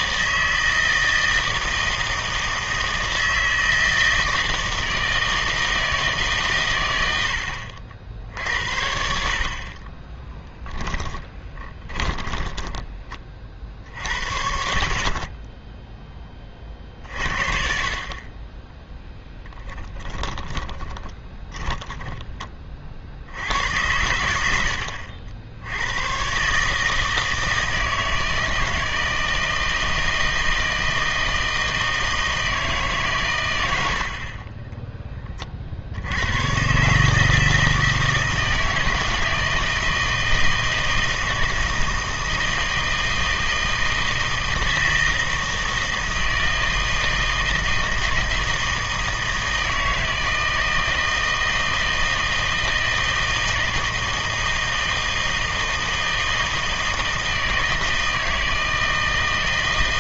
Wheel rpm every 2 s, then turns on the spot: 160, 160, 160, 130, 70, 10, 20, 50, 30, 10, 30, 30, 80, 140, 160, 160, 160, 20, 130, 160, 160, 160, 160, 160, 160, 160, 160, 160, 160, 160.
10-14 20-22